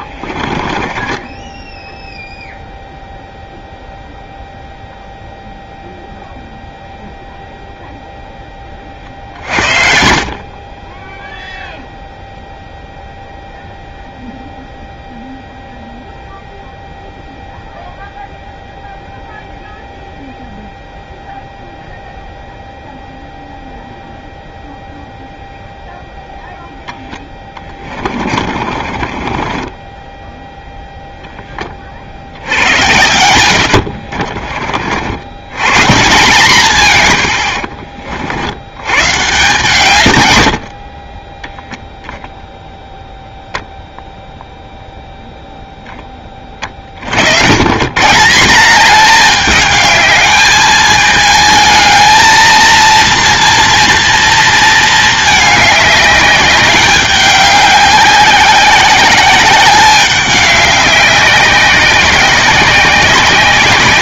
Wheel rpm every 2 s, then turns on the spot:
30, 0, 0, 0, 20, 30, 0, 0, 0, 0, 0, 0, 0, 0, 40, 10, 70, 50, 150, 80, 70, 0, 0, 30, 190, 220, 230, 220, 200, 190, 200, 190.
0-2 28-30 32-34